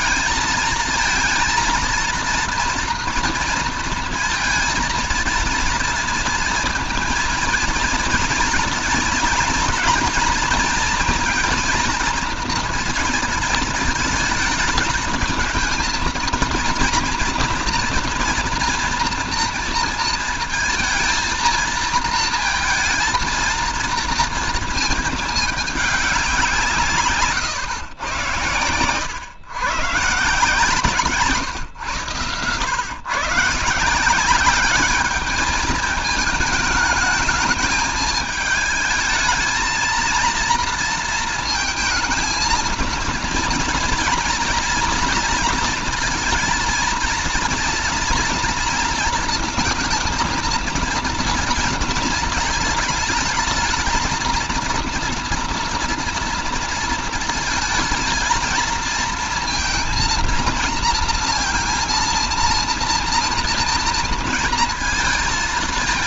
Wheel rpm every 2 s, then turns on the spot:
220, 230, 230, 230, 220, 230, 230, 220, 230, 230, 220, 220, 220, 180, 110, 160, 120, 200, 210, 220, 230, 230, 240, 240, 230, 230, 230, 230, 230, 230, 230, 230, 230.
none